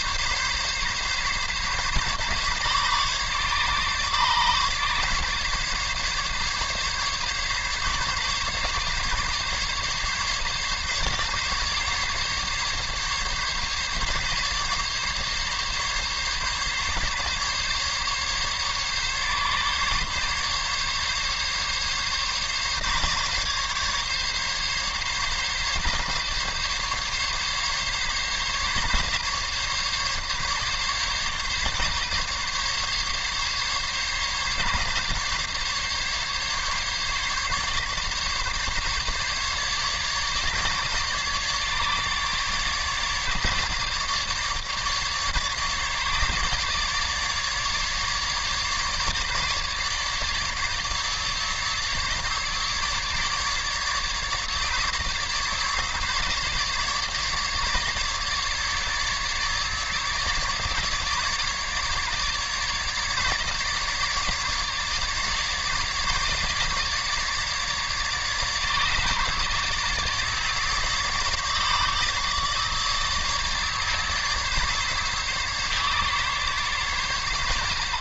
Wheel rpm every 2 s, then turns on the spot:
140, 140, 140, 140, 140, 140, 140, 140, 140, 140, 140, 140, 140, 140, 140, 140, 140, 140, 140, 150, 150, 150, 150, 150, 150, 150, 150, 150, 150, 150, 150, 150, 150, 150, 150, 150, 150, 140, 120.
none